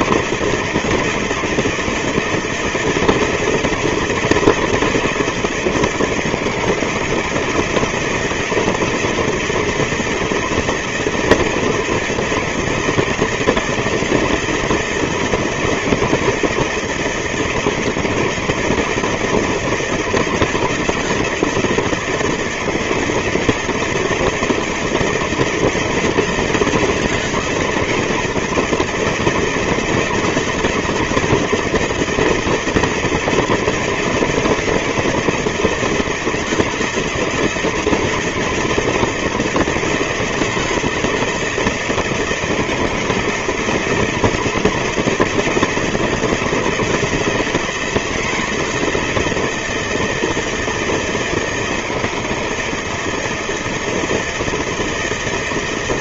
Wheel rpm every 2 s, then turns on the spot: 160, 170, 170, 160, 160, 160, 170, 160, 160, 150, 160, 160, 160, 160, 160, 160, 170, 160, 160, 160, 160, 160, 160, 170, 170, 160, 160, 160.
none